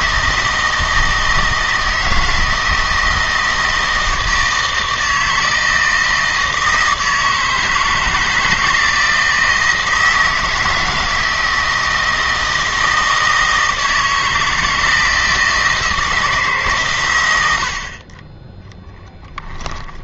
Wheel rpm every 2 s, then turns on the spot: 160, 160, 160, 160, 160, 160, 160, 160, 140, 10.
none